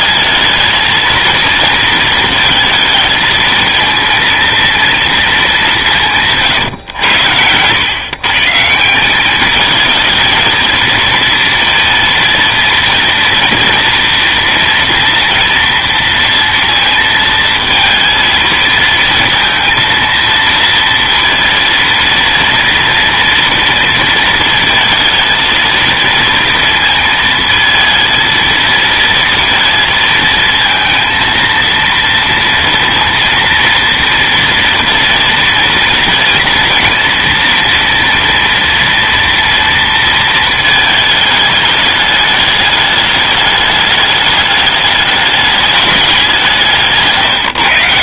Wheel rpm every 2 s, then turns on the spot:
220, 220, 230, 120, 160, 230, 230, 230, 230, 230, 230, 230, 230, 230, 230, 230, 230, 230, 230, 230, 220, 210, 210, 170.
none